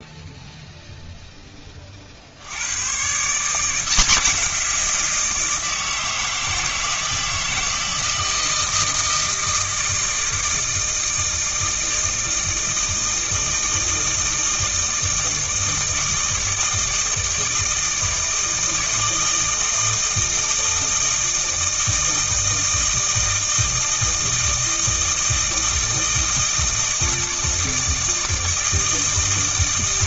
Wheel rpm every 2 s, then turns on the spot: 0, 110, 170, 160, 160, 160, 160, 160, 160, 160, 160, 160, 160, 160, 160.
none